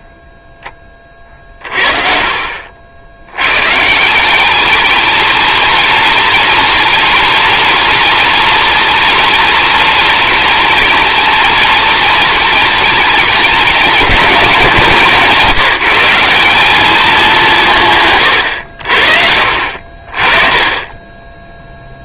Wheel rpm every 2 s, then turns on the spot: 10, 70, 200, 210, 210, 210, 210, 180, 200, 90, 20.
none